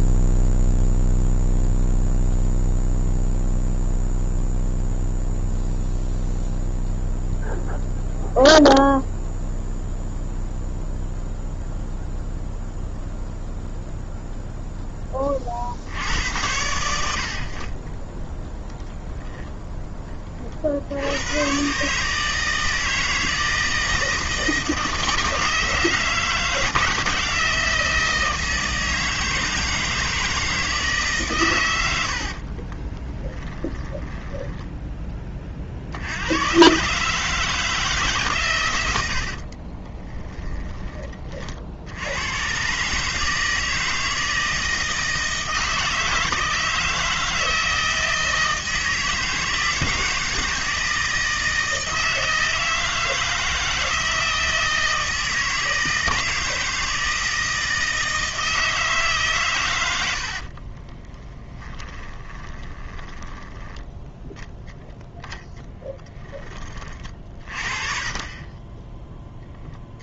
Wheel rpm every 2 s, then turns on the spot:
0, 0, 0, 0, 0, 0, 0, 0, 90, 10, 50, 160, 160, 160, 160, 160, 30, 10, 120, 120, 20, 130, 160, 160, 160, 160, 160, 160, 160, 160, 40, 10, 0, 30, 20.
32-34 40-42 60-64